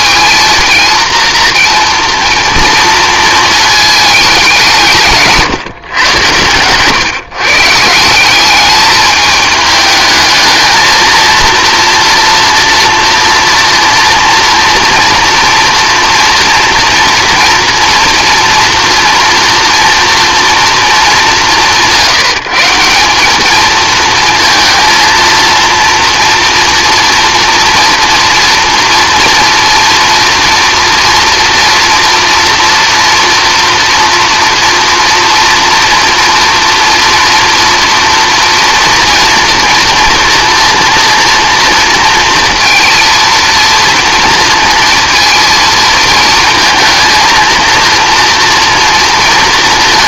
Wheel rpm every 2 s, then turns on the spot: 230, 230, 180, 130, 200, 220, 230, 230, 240, 240, 230, 180, 220, 230, 230, 230, 230, 230, 230, 240, 230, 230, 230, 230, 230.
none